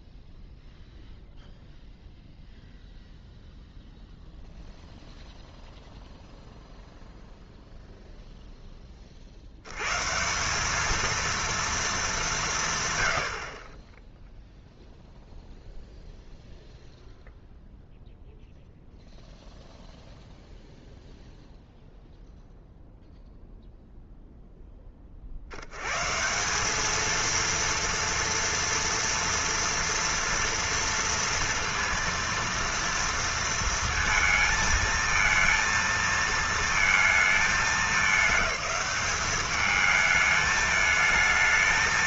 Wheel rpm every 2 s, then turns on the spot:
0, 0, 0, 0, 10, 210, 130, 0, 0, 0, 0, 0, 10, 200, 230, 240, 230, 230, 230, 200, 220.
none